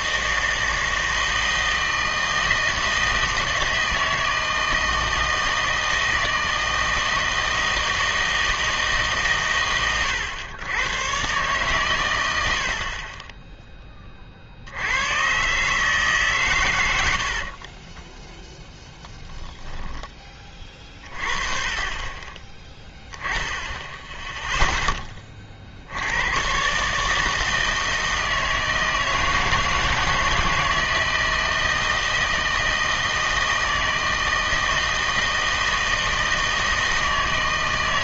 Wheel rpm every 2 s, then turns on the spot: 160, 160, 160, 160, 160, 110, 50, 90, 100, 10, 30, 10, 10, 140, 160, 160, 160, 160, 160.
none